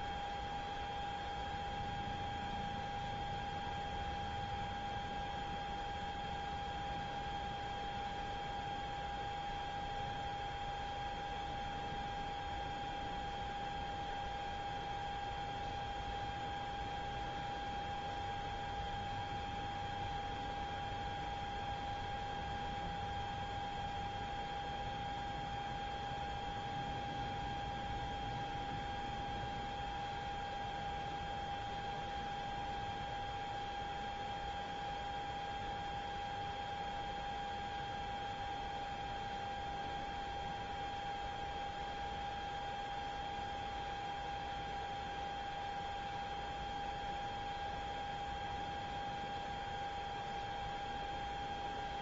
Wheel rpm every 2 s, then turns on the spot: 0, 0, 0, 0, 0, 0, 0, 0, 0, 0, 0, 0, 0, 0, 0, 0, 0, 0, 0, 0, 0, 0, 0, 0, 0, 0.
none